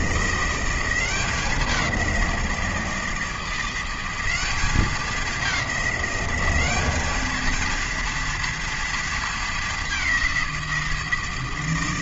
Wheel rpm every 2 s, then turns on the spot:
180, 170, 200, 200, 230, 170.
none